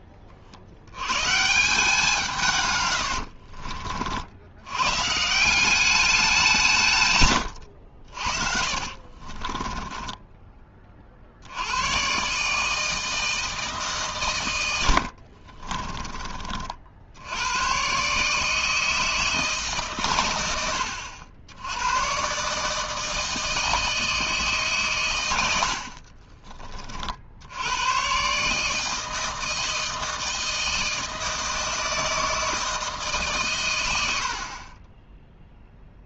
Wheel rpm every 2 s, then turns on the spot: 70, 130, 110, 170, 60, 30, 150, 90, 50, 160, 90, 150, 140, 30, 150, 160, 160, 30.
8-10 14-16